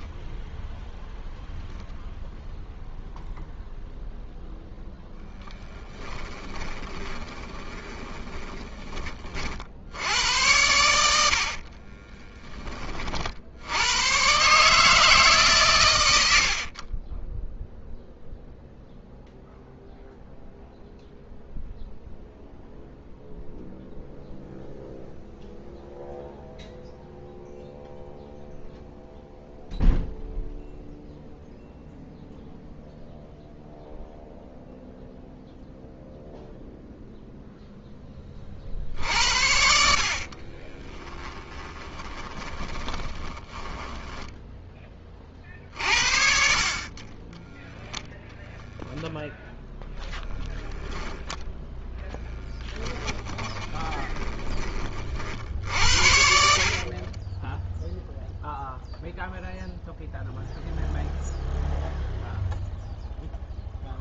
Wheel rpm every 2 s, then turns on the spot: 0, 0, 10, 20, 40, 70, 50, 150, 10, 0, 0, 0, 0, 0, 0, 0, 0, 0, 0, 60, 10, 20, 10, 40, 0, 0, 10, 20, 50, 0, 0, 0.
6-8 10-12 16-18 40-44 52-54 56-58